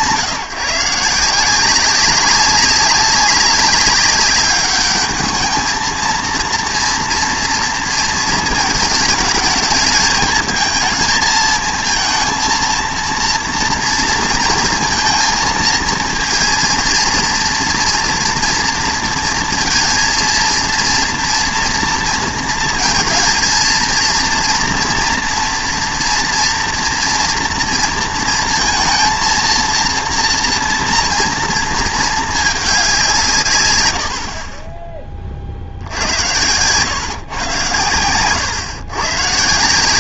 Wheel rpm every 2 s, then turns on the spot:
170, 190, 200, 230, 220, 230, 230, 230, 230, 230, 230, 230, 230, 230, 230, 240, 190, 20, 110, 110.
none